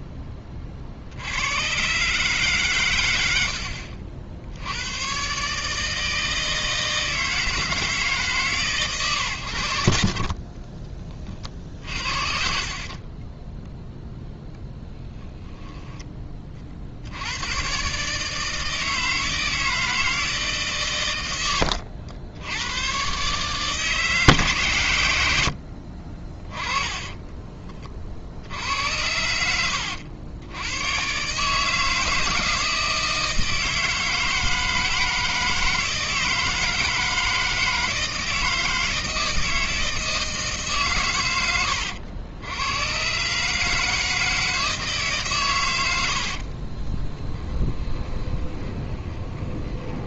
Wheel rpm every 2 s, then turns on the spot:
50, 120, 100, 160, 130, 30, 40, 0, 70, 160, 130, 110, 110, 20, 80, 110, 160, 160, 160, 160, 140, 110, 150, 20, 20.
10-14 26-28 46-50